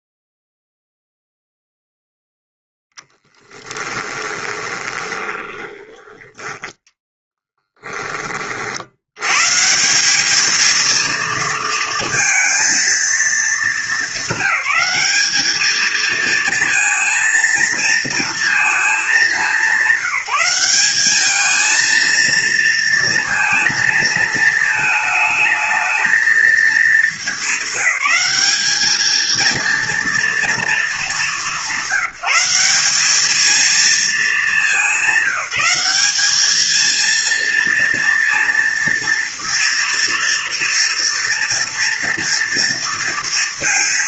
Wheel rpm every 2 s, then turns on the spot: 0, 0, 20, 10, 40, 210, 230, 210, 230, 230, 190, 230, 220, 220, 200, 230, 180, 210, 210, 230, 230, 230.
4-6